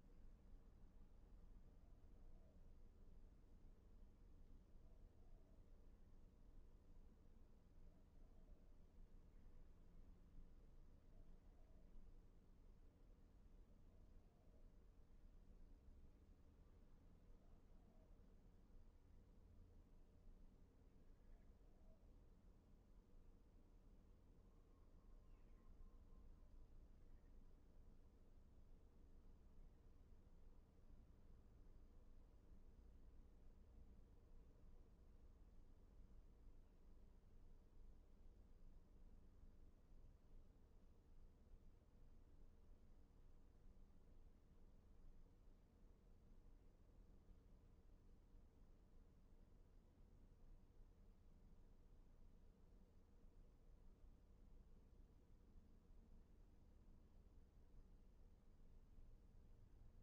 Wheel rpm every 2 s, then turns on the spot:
0, 0, 0, 0, 0, 0, 0, 0, 0, 0, 0, 0, 0, 0, 0, 0, 0, 0, 0, 0, 0, 0, 0, 0, 0, 0, 0, 0, 0, 0.
none